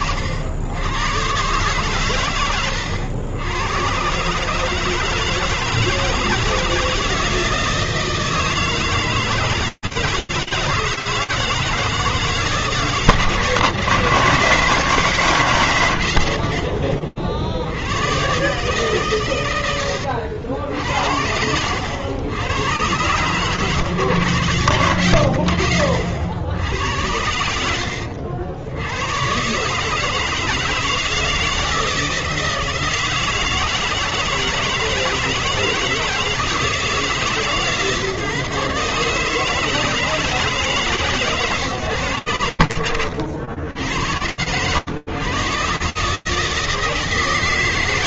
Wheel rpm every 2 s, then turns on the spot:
40, 120, 90, 150, 160, 160, 160, 150, 150, 70, 110, 70, 130, 70, 80, 140, 160, 160, 160, 150, 150, 130, 80, 150.
none